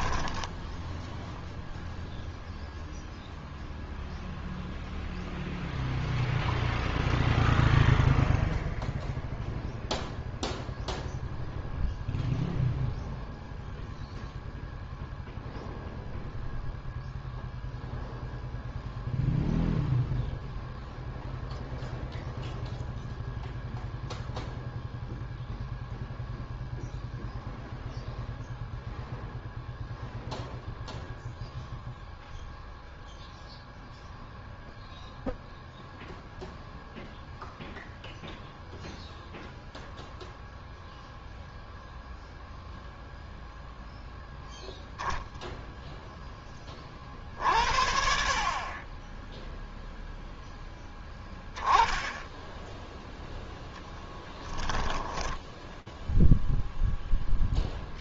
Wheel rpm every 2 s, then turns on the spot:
10, 0, 0, 0, 0, 0, 0, 0, 0, 0, 0, 0, 0, 0, 0, 0, 0, 0, 0, 0, 0, 0, 10, 10, 40, 0, 10, 10, 0.
54-56